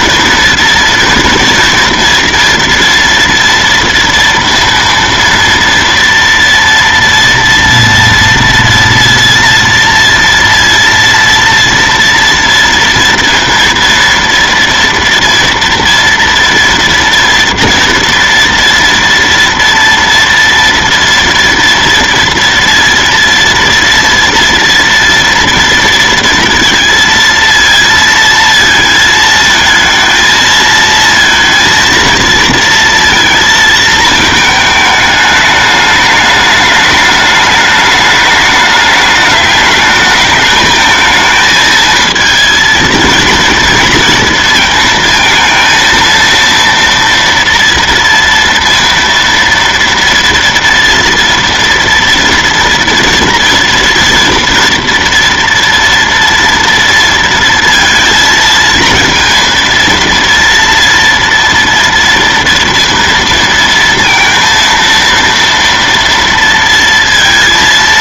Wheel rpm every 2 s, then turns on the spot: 230, 230, 230, 230, 230, 230, 230, 230, 240, 230, 230, 230, 230, 230, 220, 220, 230, 220, 210, 210, 220, 230, 220, 230, 230, 230, 230, 230, 230, 230, 230, 230, 230, 230.
none